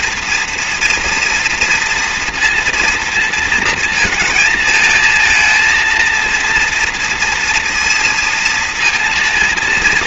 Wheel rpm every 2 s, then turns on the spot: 230, 230, 220, 230, 230.
none